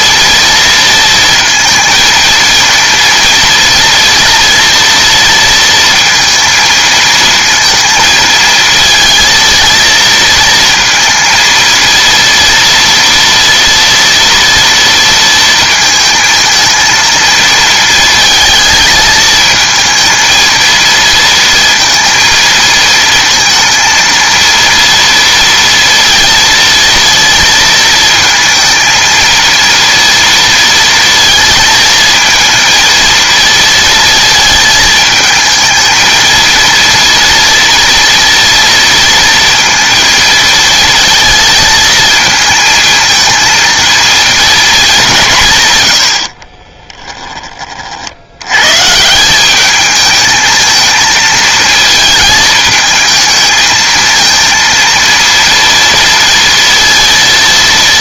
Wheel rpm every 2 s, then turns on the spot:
230, 230, 230, 230, 220, 230, 230, 230, 220, 220, 230, 230, 230, 230, 230, 230, 230, 220, 230, 230, 230, 230, 220, 30, 110, 220, 220, 230, 230.
46-48